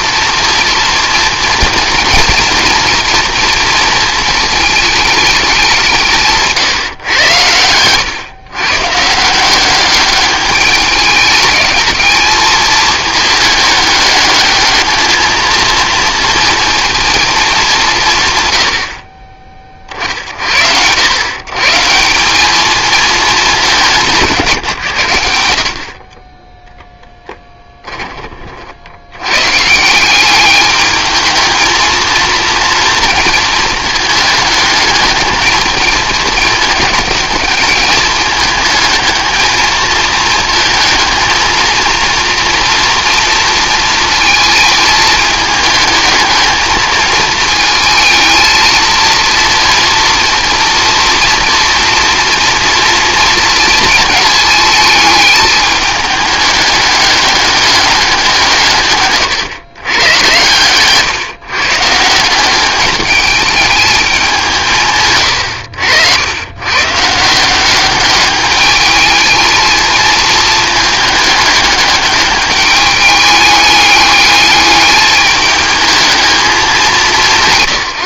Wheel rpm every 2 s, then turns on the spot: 230, 230, 220, 140, 130, 210, 220, 210, 230, 90, 70, 210, 140, 10, 60, 210, 230, 220, 220, 220, 220, 240, 220, 220, 230, 230, 230, 220, 210, 150, 130, 190, 170, 110, 210, 220, 210, 210, 210.
none